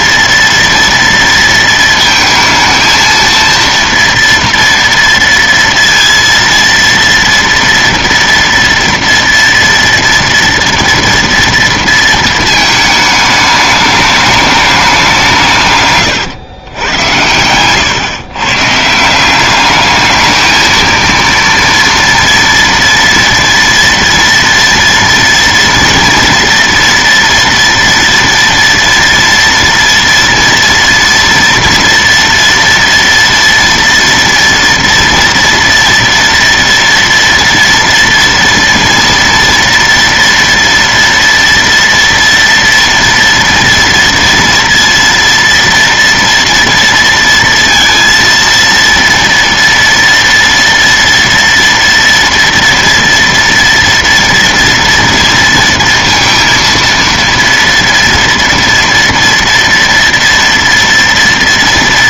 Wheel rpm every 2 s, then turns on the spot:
230, 220, 230, 230, 230, 230, 220, 210, 130, 140, 220, 240, 230, 230, 230, 230, 230, 230, 230, 230, 230, 230, 230, 230, 230, 230, 230, 230, 230, 230, 230.
none